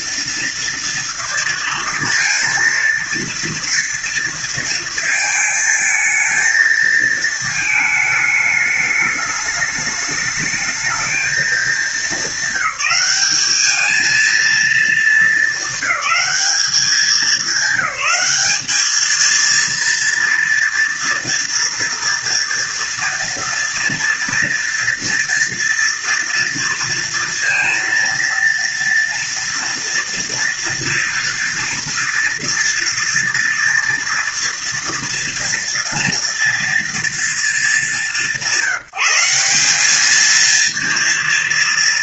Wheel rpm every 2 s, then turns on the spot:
230, 230, 230, 230, 210, 220, 210, 220, 210, 220, 230, 230, 230, 230, 230, 240, 230, 230, 230, 180, 230.
none